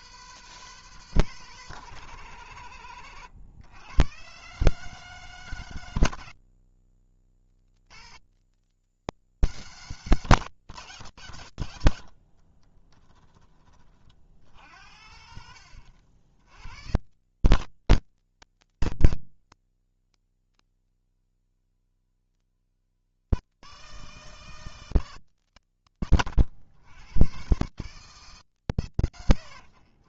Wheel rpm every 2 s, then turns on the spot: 160, 120, 150, 90, 160, 140, 20, 80, 110, 120, 150, 160, 160, 110, 100.
2-4 12-16